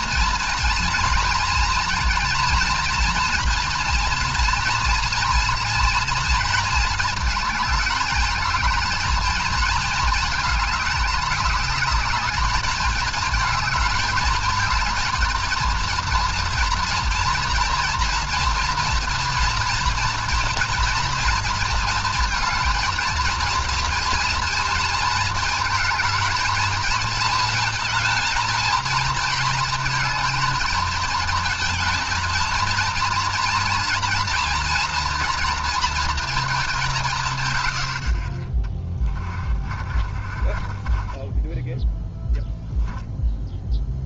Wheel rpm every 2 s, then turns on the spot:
230, 230, 230, 230, 220, 210, 210, 220, 230, 230, 240, 230, 230, 220, 230, 230, 230, 230, 210, 30, 40, 0.
40-42